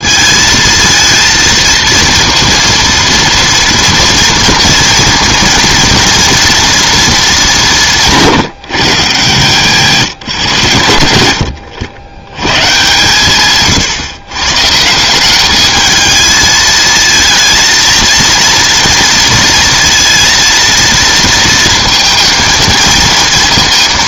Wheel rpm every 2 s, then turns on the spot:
220, 230, 230, 230, 170, 130, 120, 140, 220, 230, 230, 230.
none